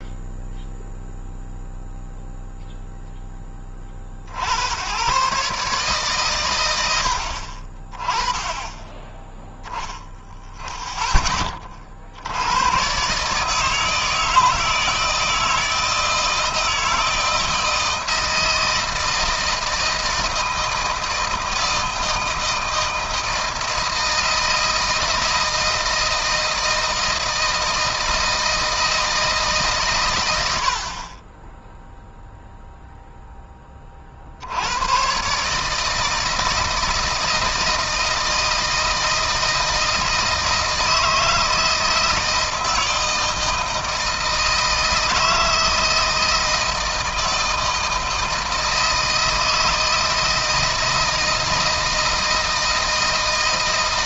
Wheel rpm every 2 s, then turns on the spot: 0, 0, 100, 80, 10, 10, 110, 160, 160, 160, 160, 160, 160, 160, 160, 50, 0, 110, 160, 160, 160, 160, 160, 160, 160, 160, 160.
none